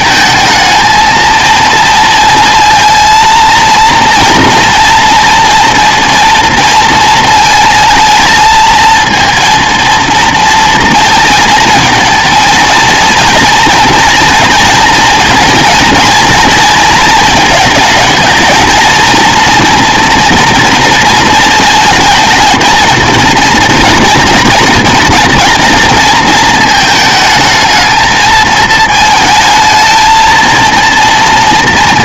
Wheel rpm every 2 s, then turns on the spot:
220, 230, 240, 230, 220, 230, 230, 230, 230, 230, 230, 220, 230, 220, 220, 230.
none